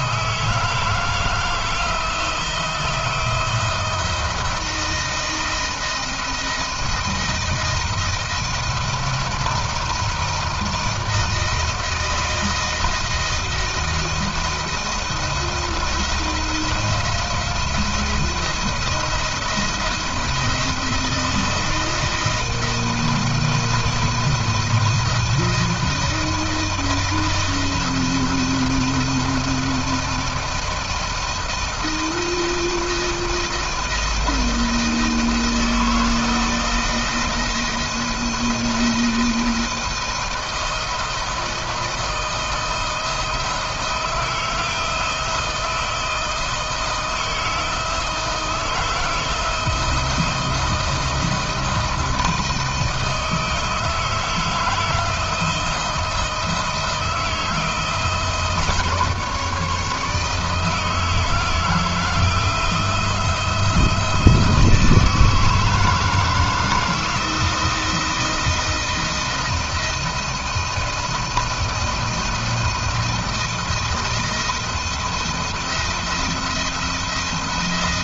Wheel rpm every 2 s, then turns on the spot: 160, 160, 160, 160, 160, 170, 170, 160, 170, 170, 170, 170, 170, 160, 170, 160, 160, 170, 160, 160, 170, 160, 160, 160, 160, 170, 160, 160, 160, 160, 160, 160, 160, 160, 170, 160, 160, 170, 170.
none